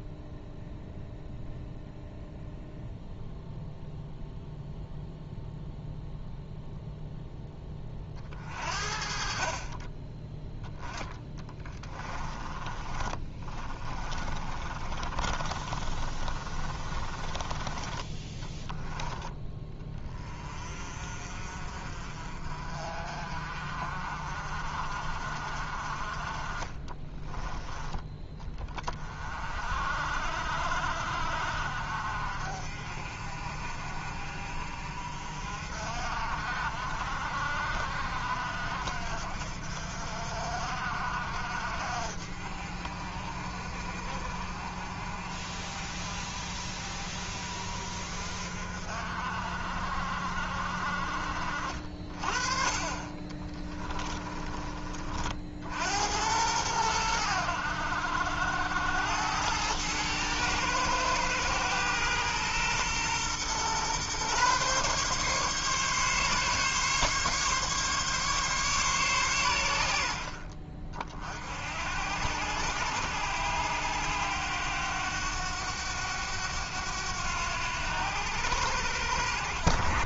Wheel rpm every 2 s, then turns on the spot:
0, 0, 0, 0, 50, 10, 20, 30, 30, 10, 40, 40, 40, 20, 30, 60, 50, 50, 60, 60, 60, 50, 50, 50, 50, 50, 30, 30, 100, 90, 110, 120, 140, 140, 140, 40, 90, 100, 90, 80.
12-18